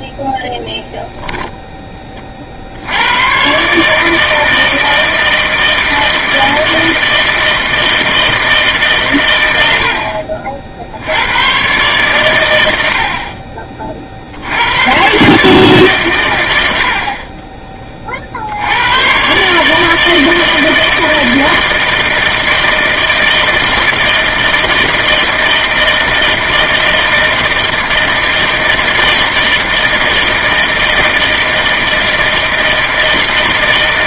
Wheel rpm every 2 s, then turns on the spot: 0, 80, 160, 160, 150, 70, 70, 110, 70, 100, 160, 160, 160, 160, 160, 160, 160.
none